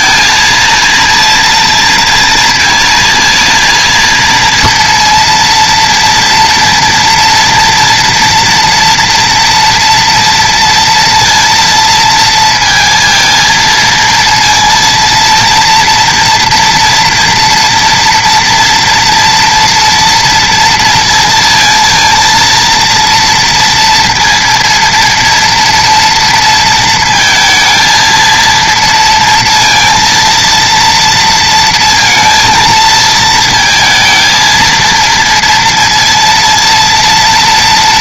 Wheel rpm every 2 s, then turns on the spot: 230, 230, 230, 230, 230, 230, 230, 230, 230, 230, 230, 230, 230, 230, 230, 230, 220, 230, 230.
none